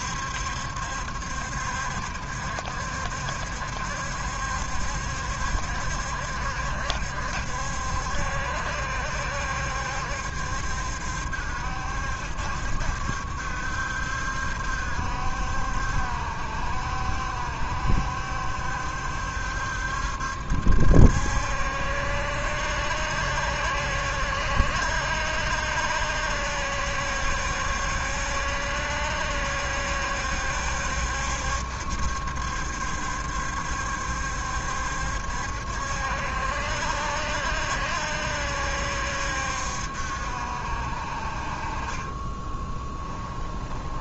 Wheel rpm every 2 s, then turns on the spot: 70, 70, 70, 70, 70, 70, 70, 70, 70, 70, 70, 70, 70, 70, 70, 70, 70, 70, 70, 70, 60, 10.
42-44